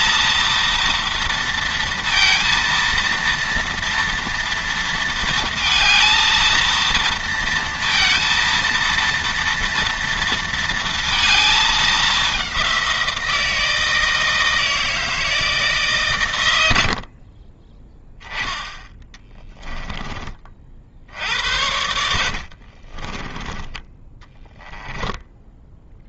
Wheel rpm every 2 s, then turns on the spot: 230, 230, 230, 230, 230, 220, 170, 160, 50, 20, 70, 20, 20.
16-20 22-26